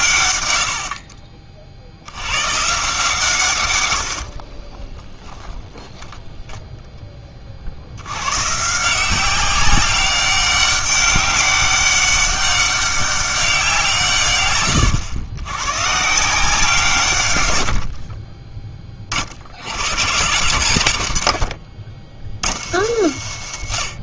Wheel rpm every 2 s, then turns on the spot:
80, 120, 30, 10, 150, 200, 200, 120, 160, 20, 120, 80.
4-6